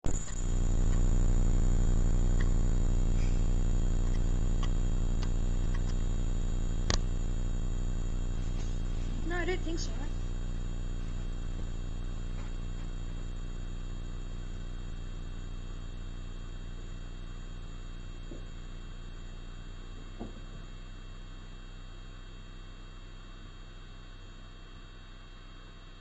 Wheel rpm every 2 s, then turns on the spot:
0, 0, 0, 0, 0, 0, 0, 0, 0, 0, 0, 0, 0.
none